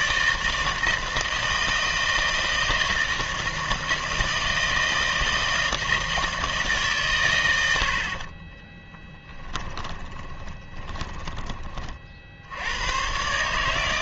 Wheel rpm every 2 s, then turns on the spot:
160, 160, 160, 160, 20, 20, 90.
8-12